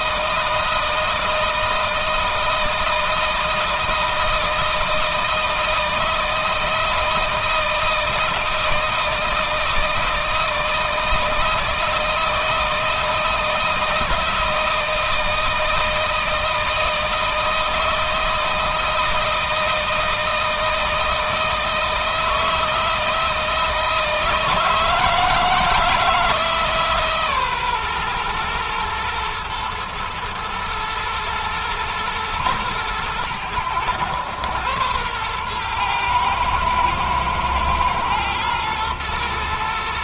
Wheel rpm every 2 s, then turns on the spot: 160, 160, 160, 160, 160, 160, 160, 160, 160, 160, 160, 160, 160, 160, 120, 110, 110, 110, 110, 110.
none